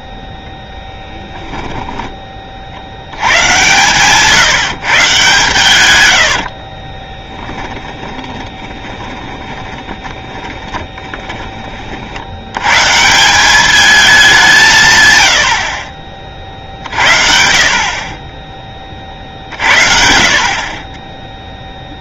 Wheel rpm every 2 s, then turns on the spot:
10, 60, 140, 40, 20, 10, 130, 150, 50, 30, 30.
0-2 6-12